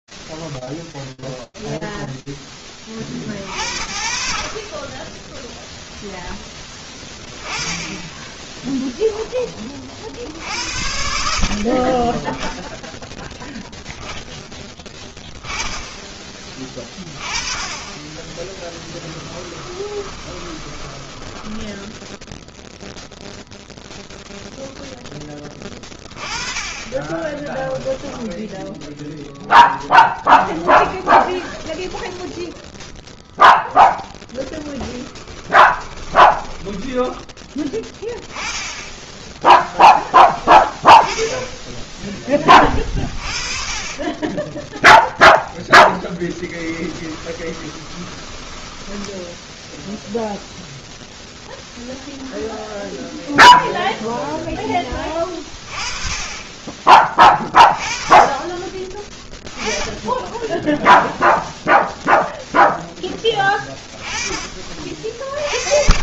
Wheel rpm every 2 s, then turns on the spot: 0, 50, 10, 10, 30, 30, 20, 20, 30, 20, 10, 0, 20, 10, 0, 10, 0, 10, 10, 10, 10, 30, 10, 20, 0, 0, 0, 30, 20, 20, 0, 10, 40.
16-20 34-36 44-48